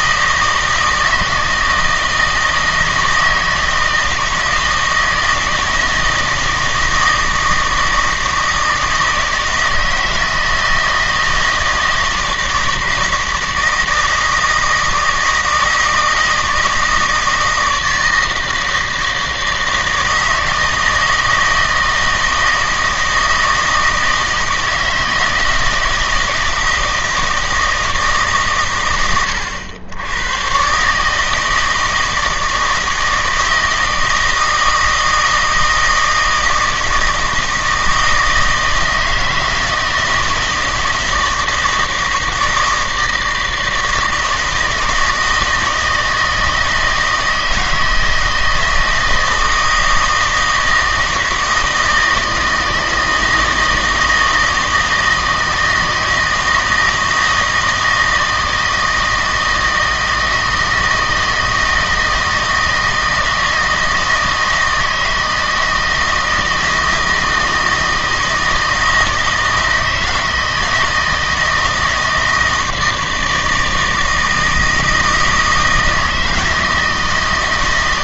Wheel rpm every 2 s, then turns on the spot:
160, 160, 160, 160, 160, 160, 160, 160, 160, 160, 160, 160, 160, 160, 120, 140, 160, 160, 160, 160, 170, 160, 160, 160, 160, 160, 160, 160, 160, 160, 160, 160, 160, 160, 160, 160, 160, 160, 160.
none